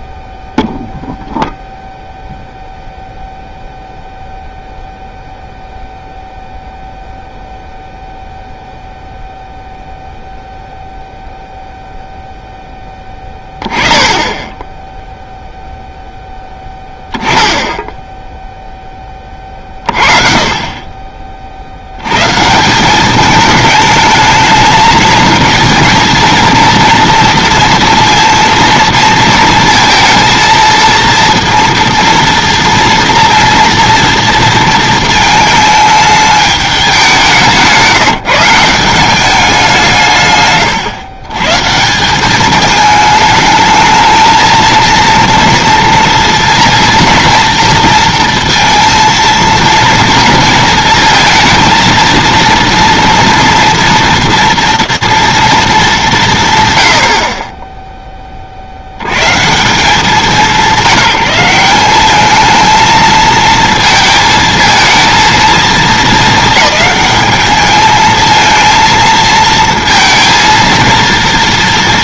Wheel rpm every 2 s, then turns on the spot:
0, 0, 0, 0, 0, 0, 0, 10, 10, 10, 40, 160, 220, 230, 230, 230, 230, 230, 210, 170, 130, 210, 230, 230, 230, 220, 230, 230, 130, 50, 180, 220, 220, 210, 230, 230.
none